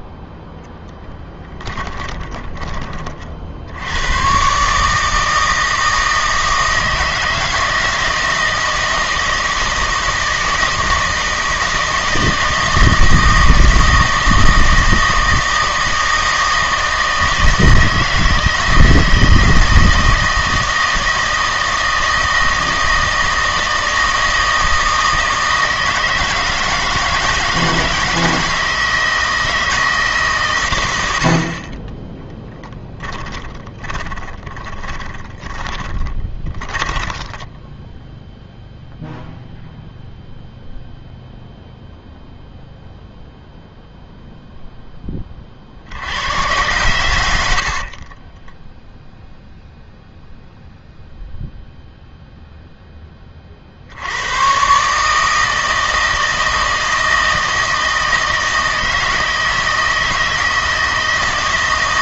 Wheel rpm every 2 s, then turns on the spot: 0, 20, 150, 160, 160, 160, 160, 160, 160, 160, 160, 160, 160, 160, 160, 100, 20, 30, 20, 0, 0, 0, 0, 110, 10, 0, 10, 130, 160, 160, 160.
32-38 48-50